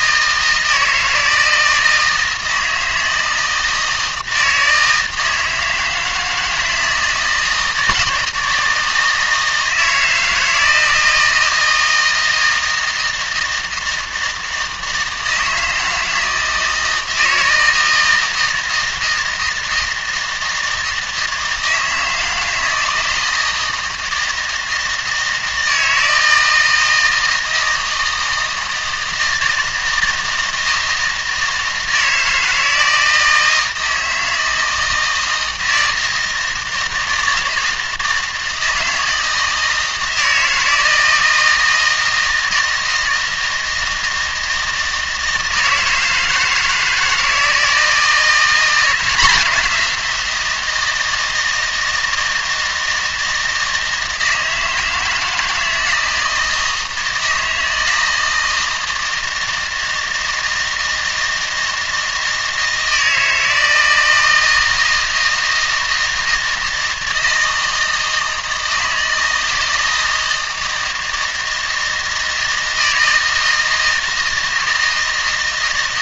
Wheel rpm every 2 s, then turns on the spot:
160, 160, 160, 160, 160, 160, 160, 160, 160, 160, 160, 160, 160, 160, 160, 160, 160, 160, 160, 160, 160, 160, 160, 160, 180, 170, 160, 160, 160, 160, 160, 160, 160, 160, 160, 160, 160, 160.
none